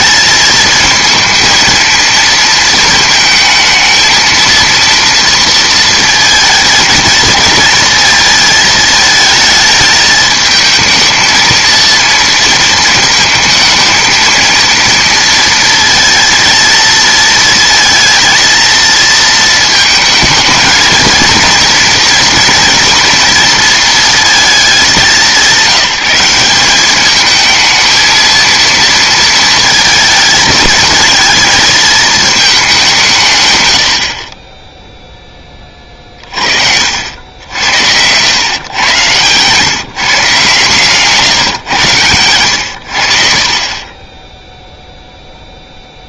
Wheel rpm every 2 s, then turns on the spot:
220, 220, 230, 220, 220, 220, 220, 230, 230, 230, 220, 230, 220, 190, 230, 220, 200, 20, 50, 120, 150, 100, 0.
none